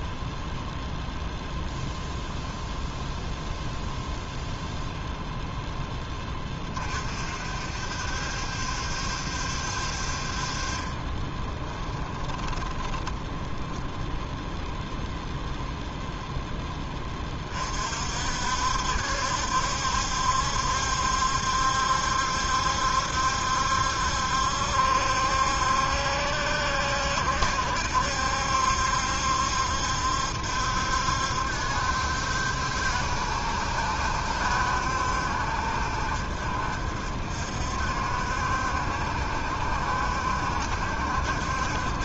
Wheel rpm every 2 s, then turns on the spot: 0, 0, 0, 30, 70, 30, 20, 0, 10, 60, 70, 70, 70, 70, 70, 70, 70, 70, 60, 70, 70.
10-14